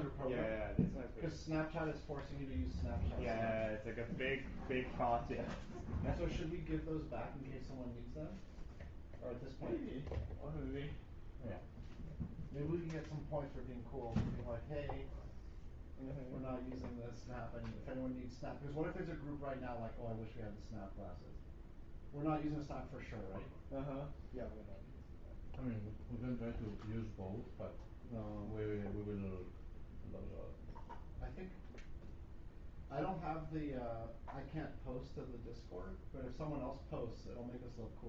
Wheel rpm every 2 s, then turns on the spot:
0, 0, 0, 0, 0, 0, 0, 0, 0, 0, 0, 0, 0, 0, 0, 0, 0, 0, 0.
none